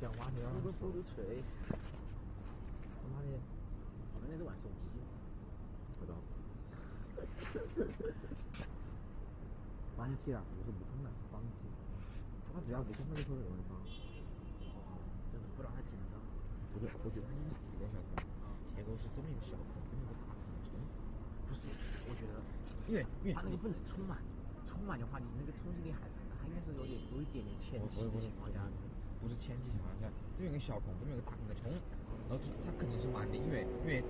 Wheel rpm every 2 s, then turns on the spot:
0, 0, 0, 0, 0, 0, 0, 0, 0, 0, 0, 0, 0, 0, 0, 0, 0.
none